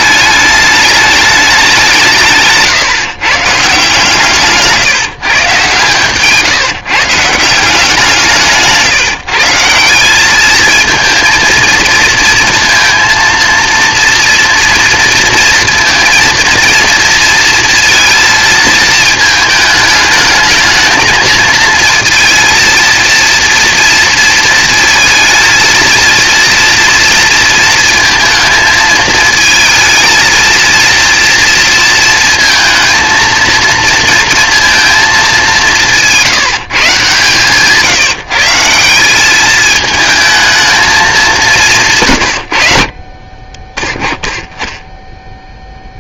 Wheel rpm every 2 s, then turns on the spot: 210, 170, 160, 150, 150, 220, 230, 230, 230, 220, 220, 230, 230, 230, 220, 230, 230, 230, 160, 180, 220, 70, 10.
none